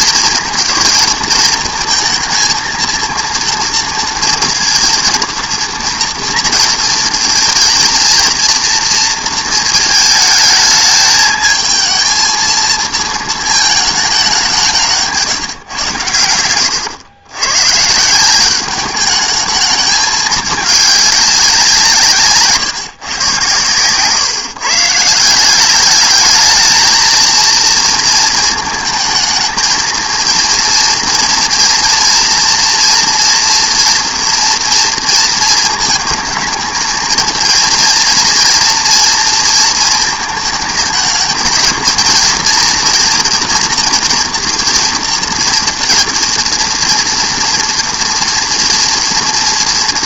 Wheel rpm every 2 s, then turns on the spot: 220, 230, 230, 230, 230, 220, 230, 180, 100, 200, 210, 130, 150, 220, 220, 230, 230, 240, 230, 230, 220, 230, 230, 230, 240.
none